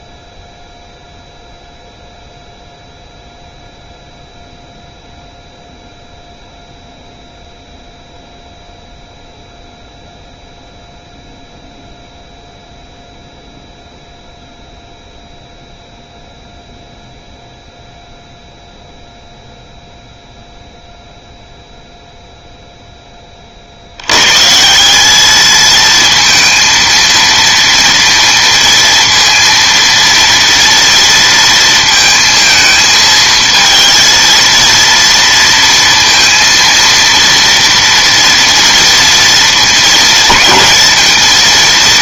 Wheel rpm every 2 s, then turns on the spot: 0, 0, 0, 0, 0, 0, 0, 0, 0, 0, 0, 0, 180, 230, 230, 230, 220, 230, 230, 230, 220.
none